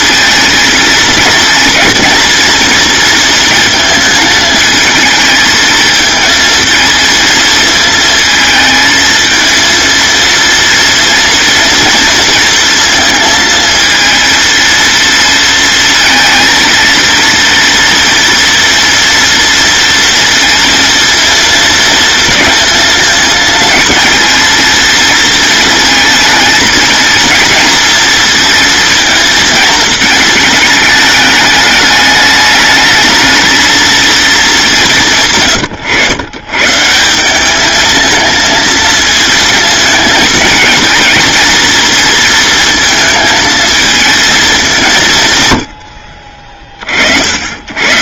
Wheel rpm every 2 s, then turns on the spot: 230, 230, 220, 230, 220, 230, 230, 230, 230, 230, 230, 220, 230, 220, 230, 220, 220, 190, 130, 220, 220, 220, 200, 40.
none